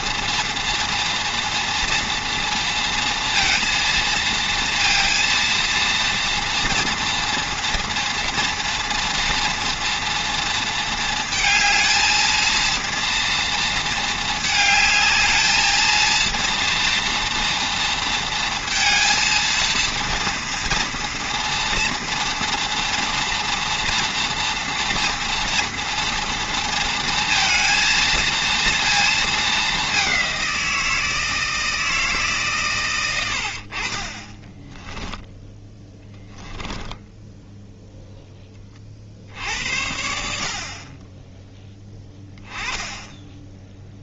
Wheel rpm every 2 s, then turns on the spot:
230, 230, 230, 230, 230, 230, 230, 220, 230, 230, 230, 230, 230, 230, 230, 170, 120, 10, 10, 30, 40, 10.
34-38